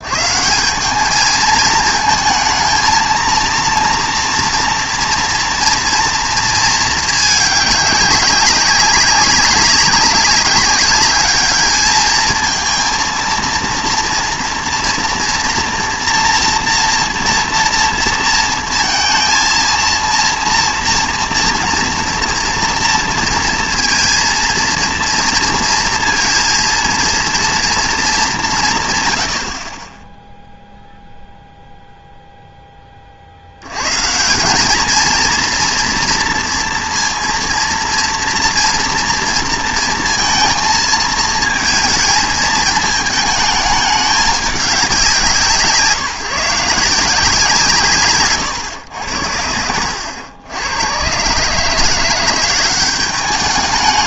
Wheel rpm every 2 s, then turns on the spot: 190, 220, 230, 220, 200, 200, 230, 230, 230, 230, 230, 230, 230, 230, 170, 0, 10, 190, 230, 230, 230, 210, 200, 160, 110, 90, 190.
none